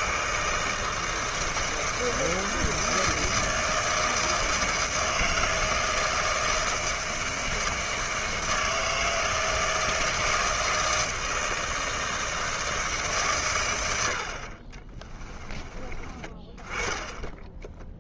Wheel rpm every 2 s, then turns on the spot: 160, 160, 160, 160, 160, 160, 160, 30, 10.
14-16